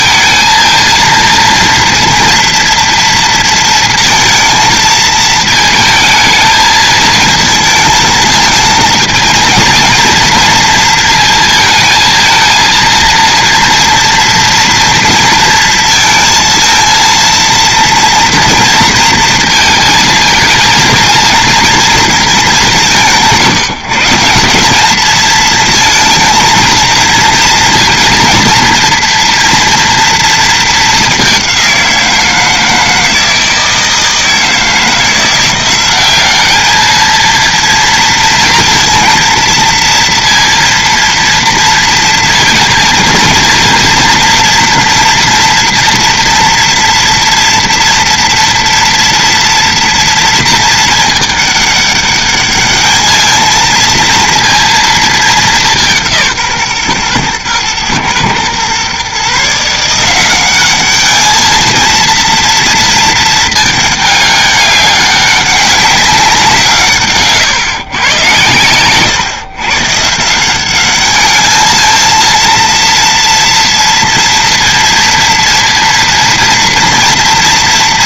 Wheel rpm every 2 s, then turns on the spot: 230, 230, 220, 220, 230, 230, 230, 230, 230, 230, 230, 190, 200, 230, 230, 220, 160, 160, 210, 230, 230, 230, 230, 230, 230, 220, 210, 230, 140, 130, 200, 230, 200, 150, 120, 190, 230, 230, 230.
none